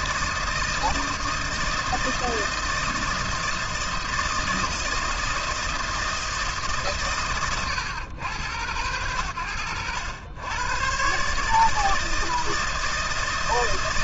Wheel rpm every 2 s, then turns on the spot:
160, 160, 160, 160, 100, 100, 160.
none